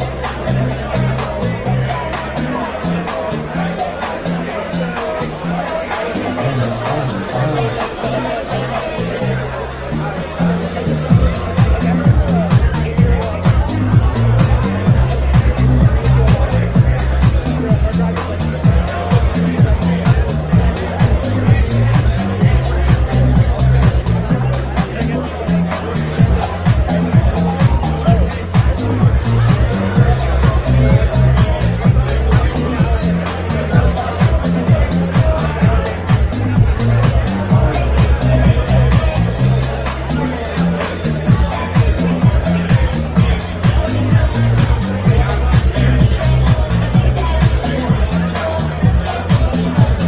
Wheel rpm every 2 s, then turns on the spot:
0, 0, 0, 0, 0, 0, 0, 0, 0, 0, 0, 0, 0, 0, 0, 0, 0, 0, 0, 0, 0, 0, 0, 0, 0.
none